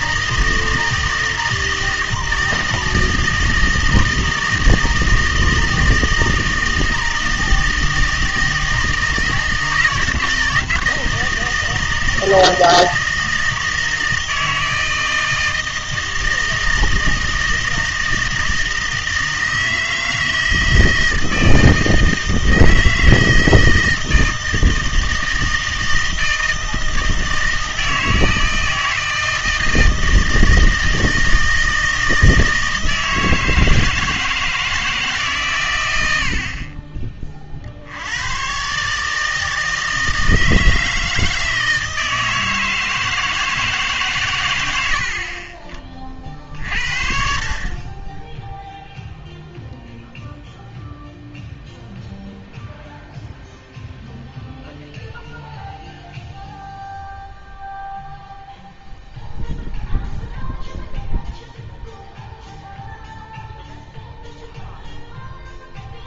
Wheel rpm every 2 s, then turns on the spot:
160, 160, 160, 160, 160, 160, 160, 160, 160, 160, 160, 160, 160, 160, 160, 160, 160, 160, 40, 130, 160, 160, 90, 50, 0, 0, 0, 0, 0, 0, 0, 0, 0.
none